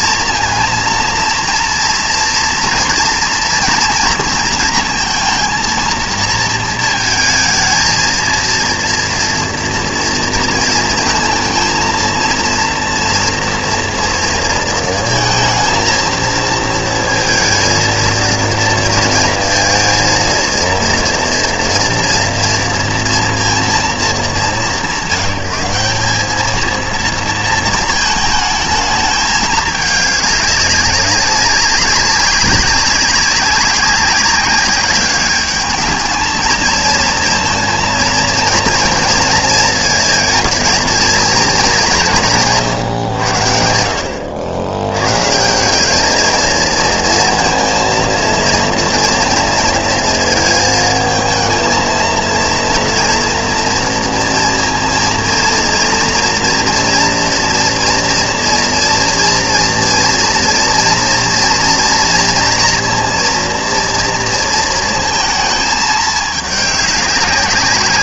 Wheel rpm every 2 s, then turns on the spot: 230, 230, 230, 230, 230, 230, 230, 230, 220, 230, 230, 240, 170, 220, 220, 200, 190, 190, 230, 230, 220, 160, 90, 230, 230, 230, 230, 230, 230, 230, 230, 230, 230, 210.
none